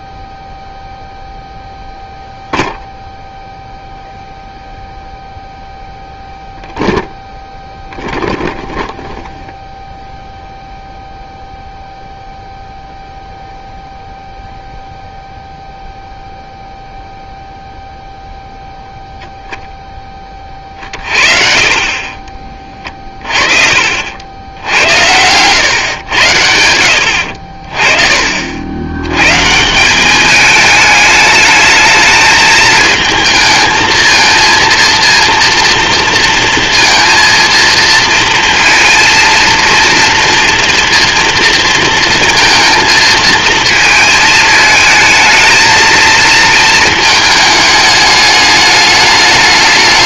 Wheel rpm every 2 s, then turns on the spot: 0, 0, 0, 0, 0, 0, 0, 0, 0, 0, 40, 30, 90, 70, 120, 210, 220, 230, 230, 230, 230, 220, 220, 220, 210.
22-24 26-28